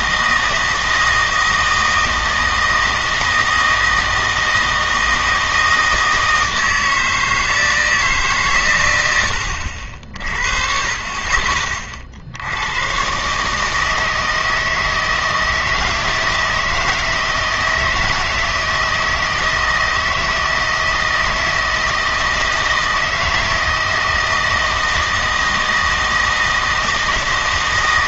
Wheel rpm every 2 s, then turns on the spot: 160, 160, 160, 160, 120, 30, 110, 160, 160, 160, 160, 160, 160, 160.
none